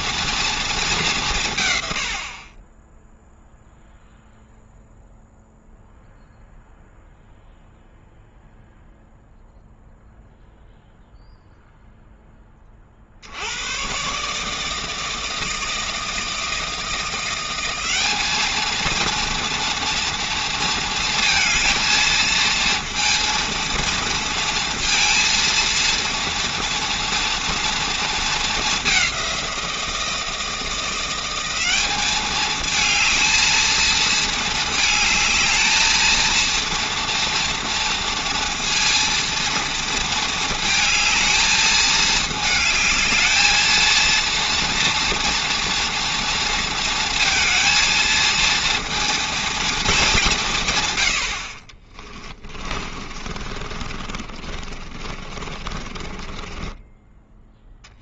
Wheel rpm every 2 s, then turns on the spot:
220, 20, 0, 0, 0, 0, 20, 150, 160, 220, 230, 230, 230, 230, 210, 170, 220, 220, 230, 230, 220, 220, 230, 230, 230, 140, 30, 30, 10.
52-58